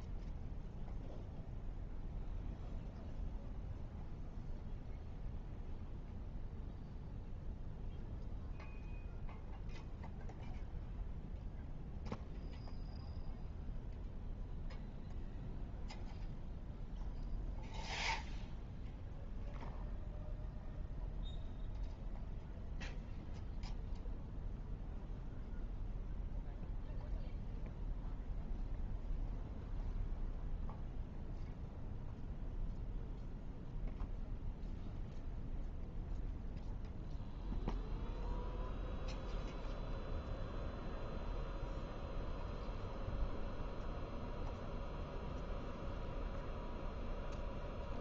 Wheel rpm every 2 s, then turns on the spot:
0, 0, 0, 0, 0, 0, 0, 0, 0, 0, 0, 0, 0, 0, 0, 0, 0, 0, 0, 0, 0, 0, 0, 0.
none